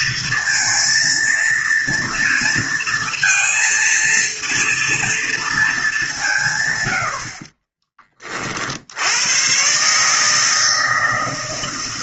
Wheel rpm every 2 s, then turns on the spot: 230, 230, 230, 90, 70, 150.
none